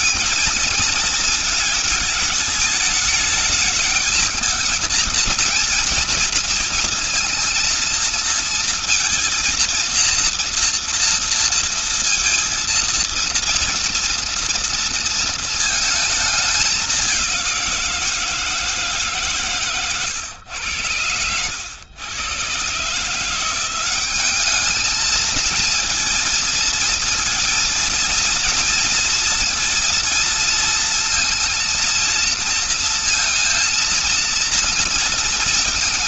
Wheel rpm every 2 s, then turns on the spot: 230, 210, 220, 230, 230, 230, 230, 230, 210, 170, 120, 120, 200, 230, 230, 230, 230, 230.
none